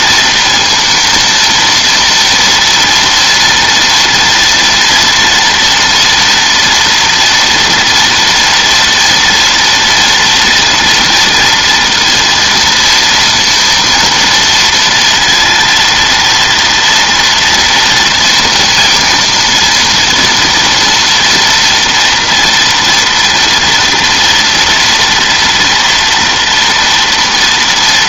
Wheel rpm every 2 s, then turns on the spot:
230, 240, 230, 230, 230, 230, 230, 230, 230, 230, 230, 230, 240, 230.
none